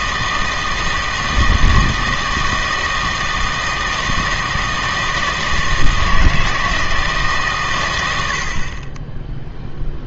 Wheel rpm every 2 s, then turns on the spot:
160, 160, 160, 160, 30.
none